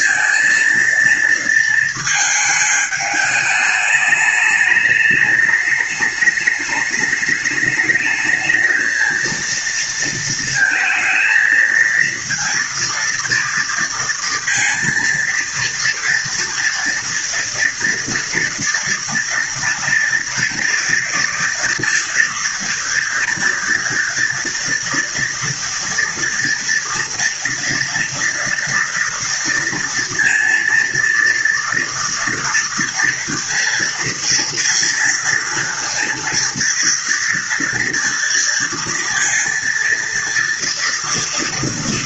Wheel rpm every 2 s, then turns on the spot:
230, 220, 210, 210, 220, 220, 230, 230, 230, 230, 230, 230, 230, 240, 230, 230, 230, 230, 230, 230, 230.
none